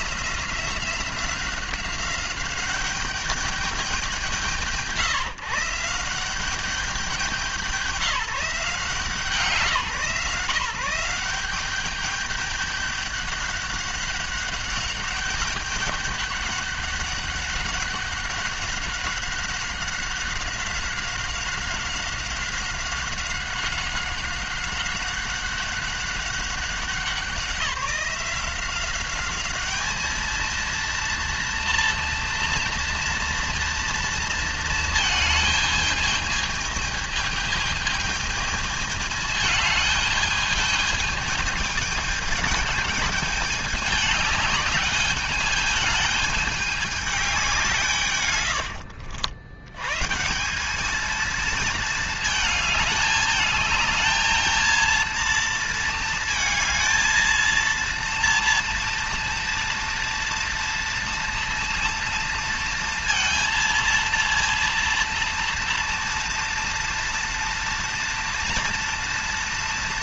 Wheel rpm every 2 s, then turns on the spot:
180, 190, 160, 190, 180, 150, 200, 200, 200, 190, 190, 190, 190, 190, 190, 220, 240, 230, 220, 220, 210, 220, 210, 210, 110, 170, 220, 230, 230, 230, 230, 230, 230, 230, 230.
none